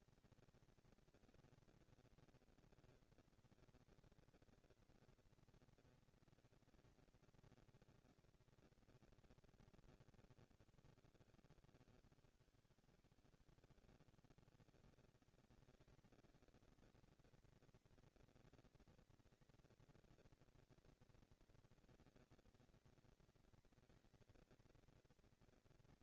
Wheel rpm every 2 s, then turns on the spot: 230, 230, 230, 230, 230, 180, 160, 180, 230, 230, 230, 230, 230.
none